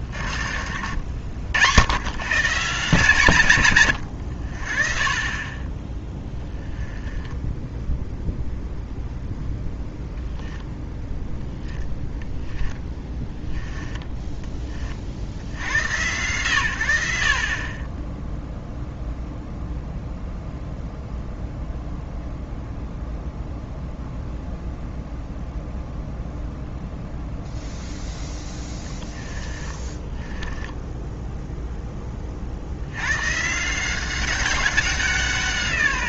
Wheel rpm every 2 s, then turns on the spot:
60, 140, 50, 10, 0, 0, 10, 30, 90, 0, 0, 0, 0, 0, 10, 10, 80, 190.
0-2 12-14 28-32